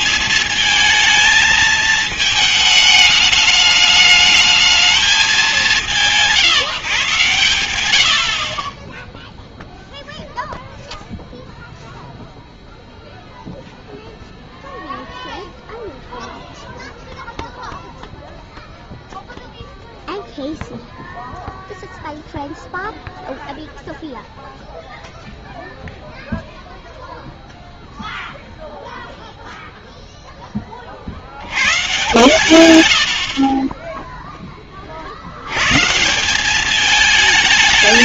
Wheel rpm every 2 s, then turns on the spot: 220, 220, 210, 170, 60, 0, 0, 0, 0, 0, 0, 0, 0, 0, 0, 20, 110, 10, 180.
none